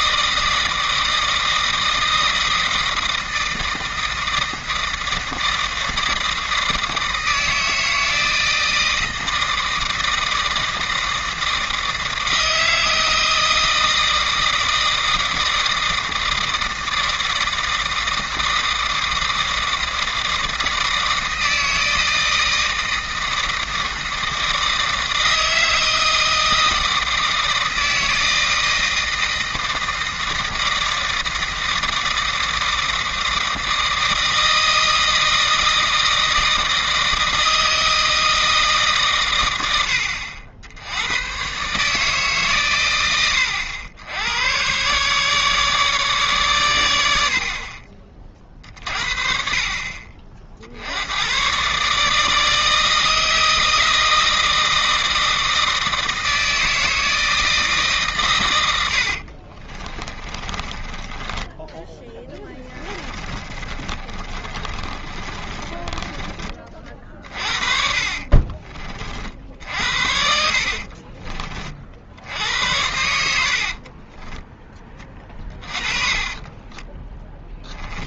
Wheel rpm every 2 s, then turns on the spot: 160, 160, 160, 160, 160, 160, 160, 160, 160, 160, 160, 160, 160, 160, 160, 160, 160, 160, 160, 150, 80, 120, 110, 110, 40, 70, 160, 160, 160, 90, 20, 20, 30, 30, 40, 60, 90, 10, 20.
60-72 76-78